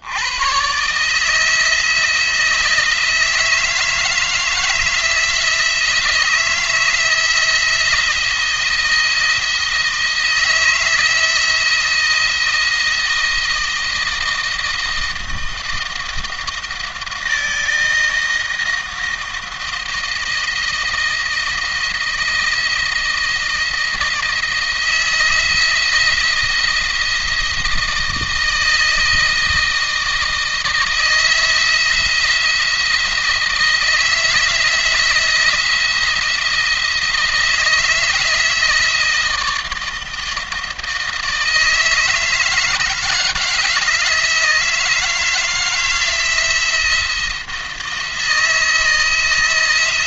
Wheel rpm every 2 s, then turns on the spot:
120, 160, 160, 160, 160, 160, 170, 160, 160, 160, 160, 160, 160, 170, 160, 160, 170, 160, 160, 160, 160, 160, 160, 170, 160.
none